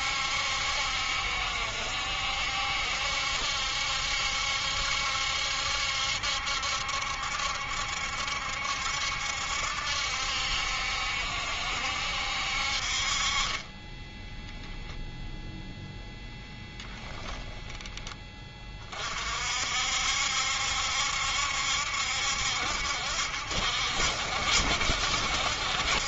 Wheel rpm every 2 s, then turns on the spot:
70, 70, 70, 70, 70, 70, 60, 0, 10, 30, 70, 70, 70.
none